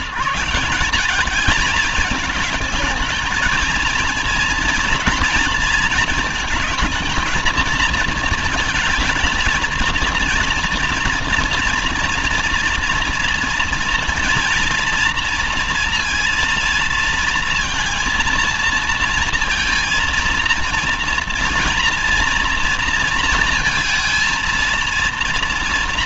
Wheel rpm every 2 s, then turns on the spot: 170, 220, 230, 230, 220, 230, 230, 230, 230, 230, 230, 230, 230.
none